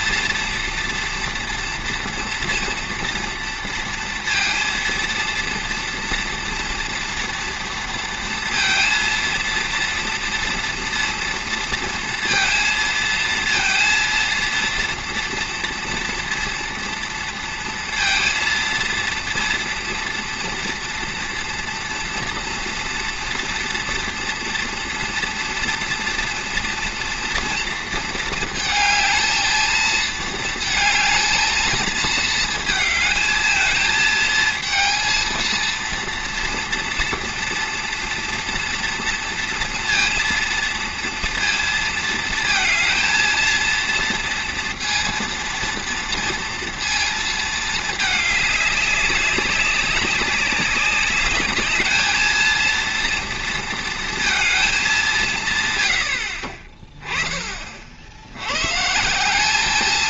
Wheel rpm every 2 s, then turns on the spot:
230, 230, 230, 230, 230, 240, 230, 230, 230, 230, 230, 230, 240, 230, 220, 220, 220, 230, 230, 230, 230, 230, 230, 230, 200, 200, 230, 220, 40, 130.
none